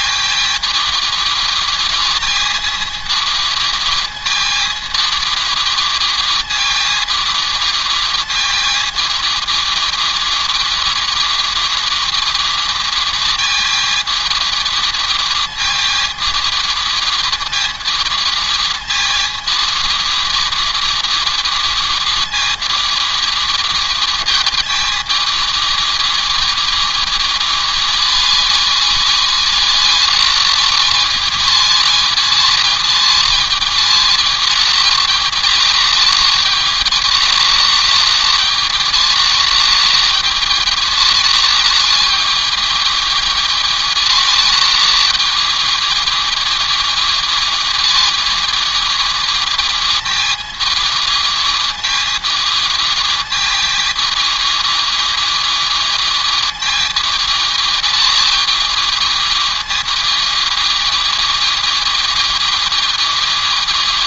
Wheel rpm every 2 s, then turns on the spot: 220, 230, 220, 220, 220, 220, 220, 220, 220, 230, 220, 220, 220, 220, 220, 220, 220, 220, 220, 220, 220, 220, 220, 220, 220, 220, 220, 220, 220, 220, 220, 220.
none